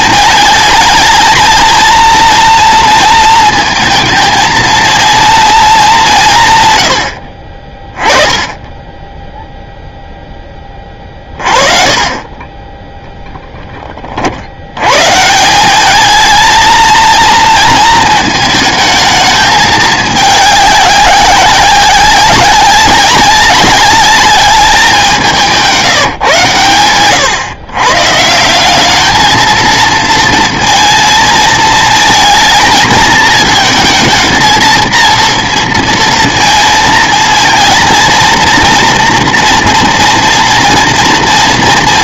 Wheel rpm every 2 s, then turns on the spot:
220, 230, 230, 120, 20, 20, 20, 80, 220, 220, 200, 200, 200, 120, 190, 230, 220, 230, 230, 230, 230.
none